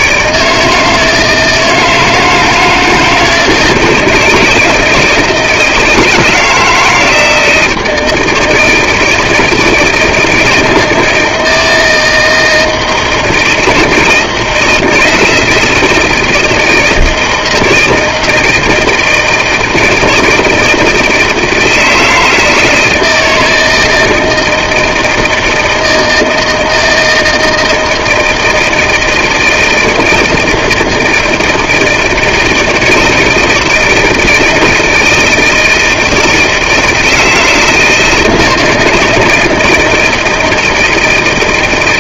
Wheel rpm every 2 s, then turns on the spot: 160, 160, 160, 160, 160, 160, 160, 170, 160, 160, 170, 160, 160, 160, 160, 160, 160, 160, 160, 160, 160.
none